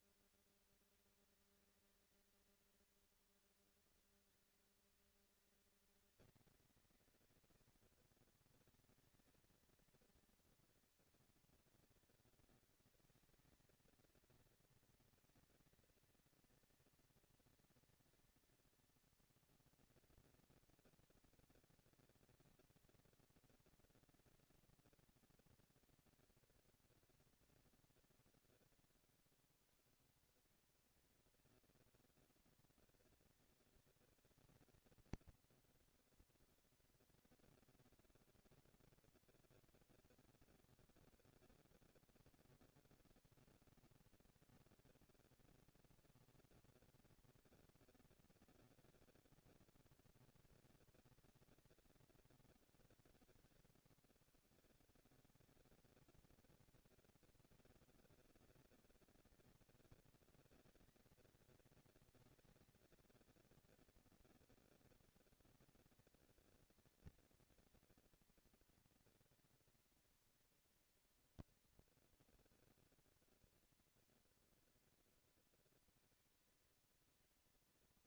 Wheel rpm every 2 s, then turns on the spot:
220, 210, 200, 190, 210, 230, 230, 230, 230, 230, 230, 230, 230, 240, 140, 160, 230, 230, 230, 230, 240, 230, 230, 230, 230, 210, 140, 130, 220, 230, 230, 230, 230, 230, 240, 230, 230, 230, 230.
none